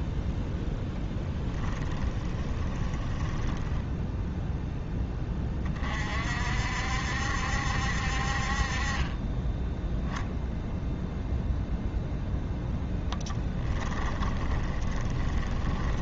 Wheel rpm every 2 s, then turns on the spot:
0, 20, 10, 70, 30, 0, 10, 20.
2-4 12-16